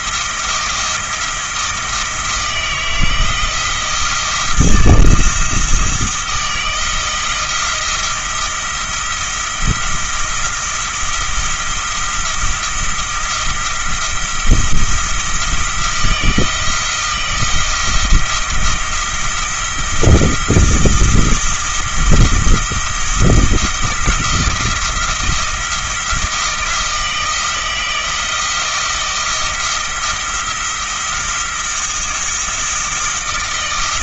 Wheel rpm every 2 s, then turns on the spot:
170, 160, 170, 160, 170, 170, 170, 170, 170, 170, 170, 170, 170, 160, 160, 160, 160.
none